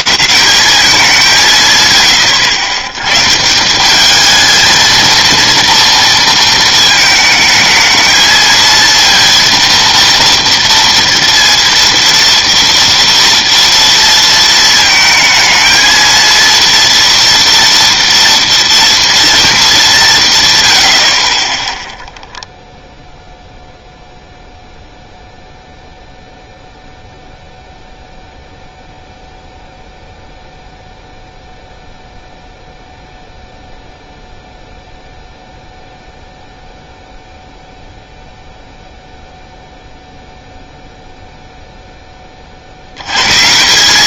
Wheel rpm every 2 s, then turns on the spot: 180, 100, 210, 230, 220, 230, 230, 230, 230, 230, 160, 0, 0, 0, 0, 0, 0, 0, 0, 0, 0, 80.
none